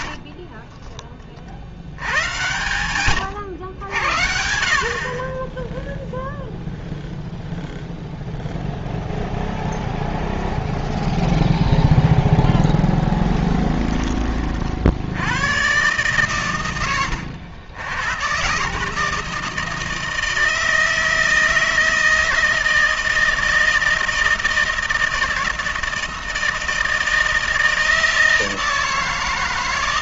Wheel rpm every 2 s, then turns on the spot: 60, 150, 90, 0, 0, 0, 10, 50, 130, 140, 160, 160, 160, 160, 160.
0-2